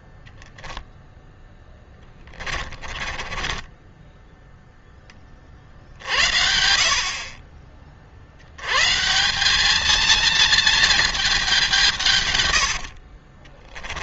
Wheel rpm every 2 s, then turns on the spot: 0, 20, 0, 60, 100, 230, 120.
2-4 12-14